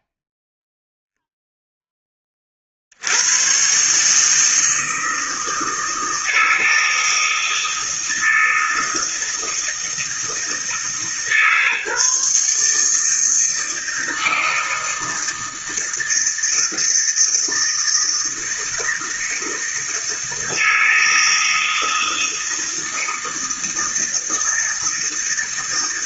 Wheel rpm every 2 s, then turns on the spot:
0, 80, 160, 160, 160, 150, 160, 160, 160, 160, 160, 160, 160.
none